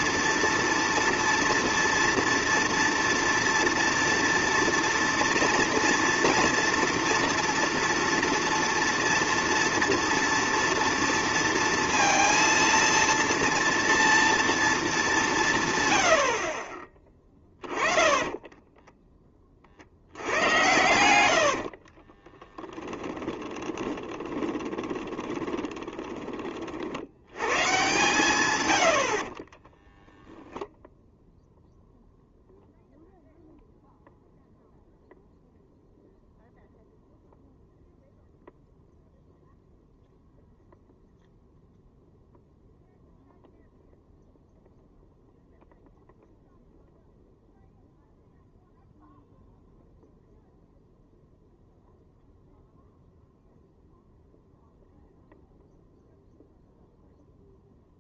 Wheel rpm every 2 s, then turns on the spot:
230, 230, 230, 230, 230, 230, 230, 230, 30, 10, 110, 10, 20, 40, 100, 10, 0, 0, 0, 0, 0, 0, 0, 0, 0, 0, 0, 0, 0.
18-26